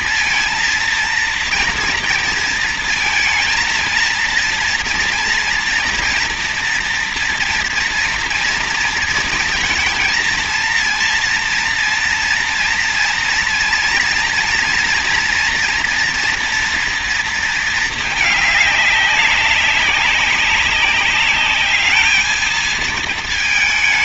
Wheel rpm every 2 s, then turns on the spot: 230, 230, 230, 230, 230, 230, 230, 230, 230, 200, 200, 220.
none